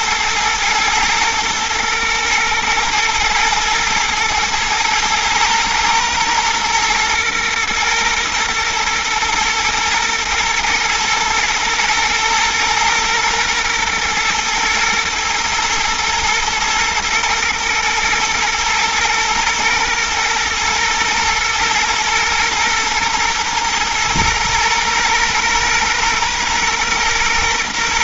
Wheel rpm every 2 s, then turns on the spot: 110, 110, 120, 120, 120, 120, 120, 120, 120, 120, 120, 120, 120, 120.
none